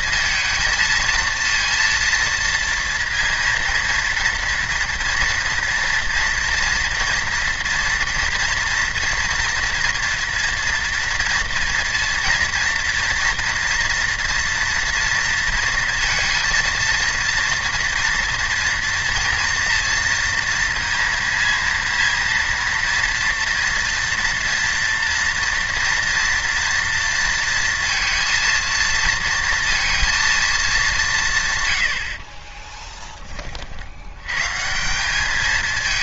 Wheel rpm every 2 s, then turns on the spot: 230, 230, 230, 240, 230, 230, 230, 230, 230, 230, 230, 230, 230, 230, 230, 220, 20, 150.
32-34